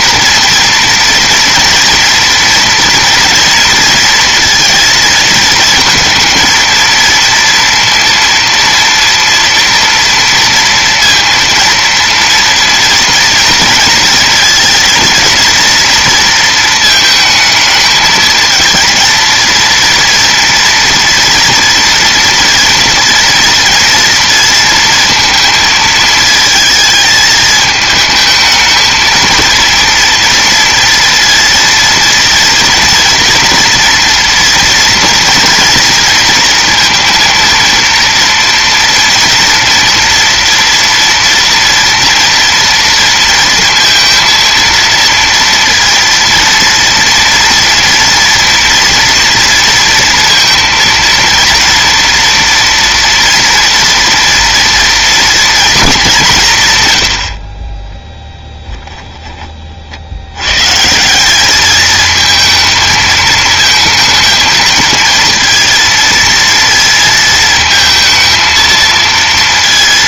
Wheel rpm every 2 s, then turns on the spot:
230, 230, 230, 220, 230, 230, 230, 230, 230, 230, 230, 240, 230, 220, 220, 230, 230, 230, 230, 230, 230, 230, 230, 230, 240, 230, 230, 230, 140, 10, 110, 220, 220, 230, 230.
58-60